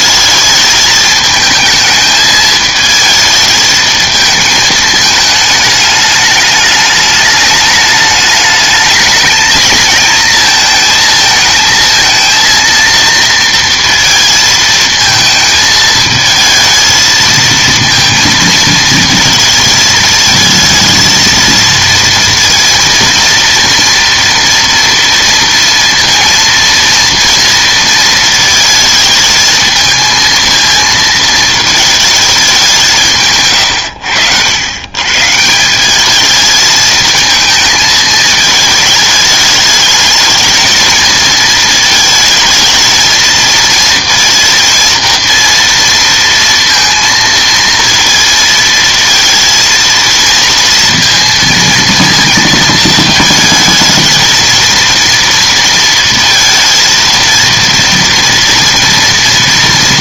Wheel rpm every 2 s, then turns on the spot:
220, 220, 220, 210, 210, 230, 230, 220, 220, 230, 220, 230, 230, 240, 220, 220, 190, 100, 220, 220, 220, 220, 230, 230, 230, 230, 220, 230, 230, 230.
none